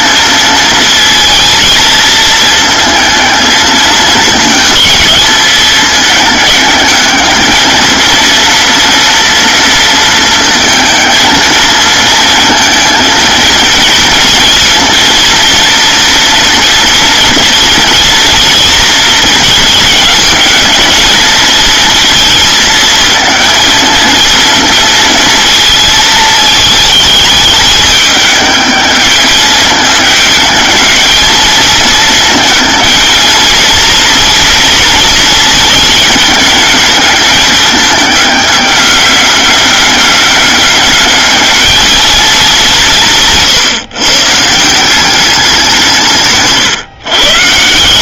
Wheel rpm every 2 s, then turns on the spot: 230, 230, 220, 210, 230, 220, 220, 230, 230, 230, 220, 220, 220, 210, 210, 220, 220, 230, 210, 200, 210, 160, 190, 140.
none